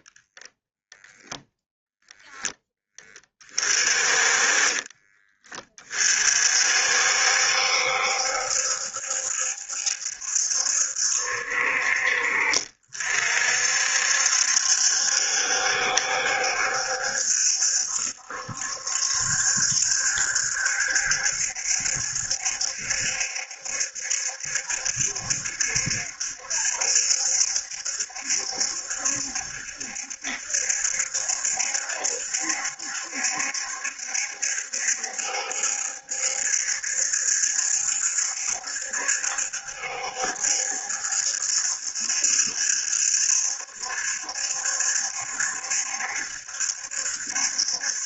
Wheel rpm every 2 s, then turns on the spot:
10, 20, 30, 60, 70, 60, 50, 70, 70, 70, 70, 70, 70, 70, 70, 70, 70, 70, 70, 70, 70, 70, 70, 70.
none